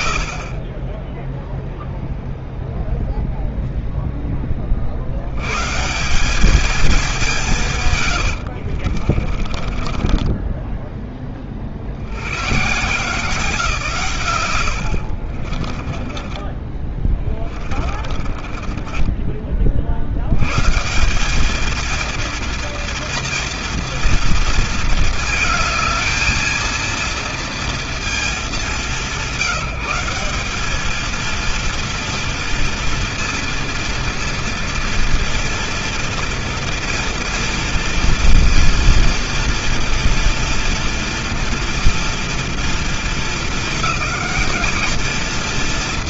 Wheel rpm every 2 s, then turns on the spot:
40, 0, 50, 210, 40, 10, 140, 80, 20, 10, 170, 230, 230, 230, 180, 220, 230, 230, 230, 230, 230, 230, 220.
8-10 14-20